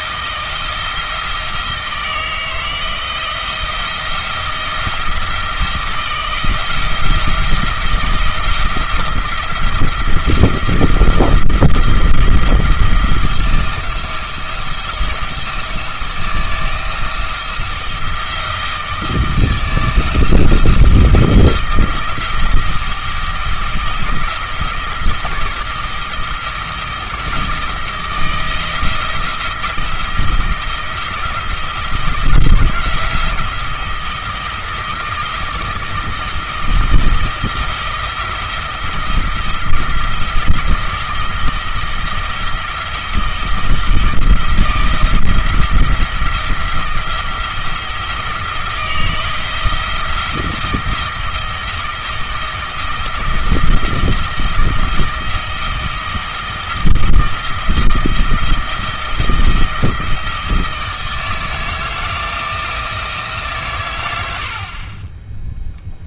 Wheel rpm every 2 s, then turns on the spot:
160, 160, 170, 170, 170, 170, 170, 160, 170, 160, 170, 170, 160, 170, 160, 170, 170, 170, 160, 160, 160, 160, 160, 170, 170, 160, 160, 160, 160, 160, 160, 160, 50.
none